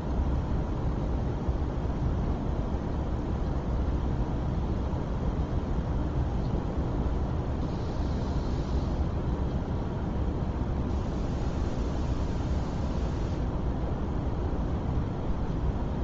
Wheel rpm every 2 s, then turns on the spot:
0, 0, 0, 0, 0, 0, 0, 0.
none